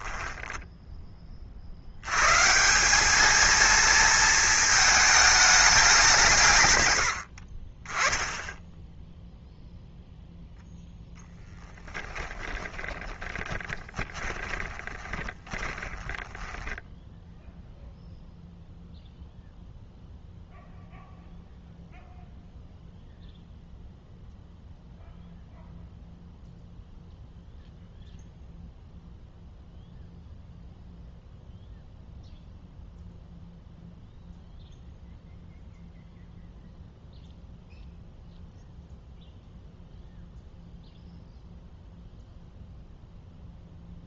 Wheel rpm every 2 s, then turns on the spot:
10, 150, 220, 140, 10, 0, 20, 20, 10, 0, 0, 0, 0, 0, 0, 0, 0, 0, 0, 0, 0, 0.
0-2 12-18